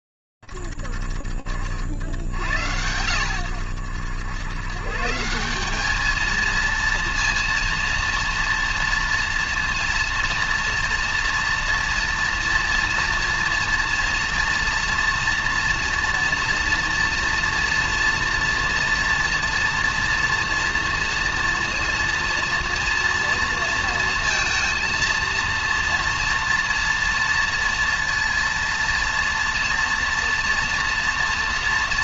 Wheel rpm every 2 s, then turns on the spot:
20, 50, 80, 200, 230, 230, 230, 230, 230, 230, 230, 230, 230, 230, 230, 230.
none